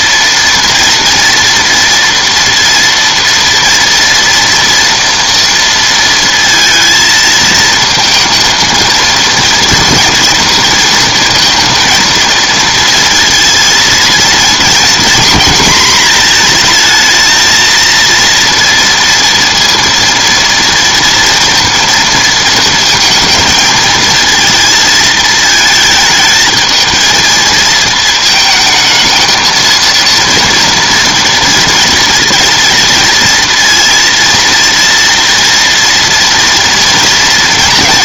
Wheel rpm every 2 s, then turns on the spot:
230, 230, 230, 220, 230, 230, 230, 230, 230, 230, 230, 220, 220, 220, 220, 240, 230, 230, 230.
none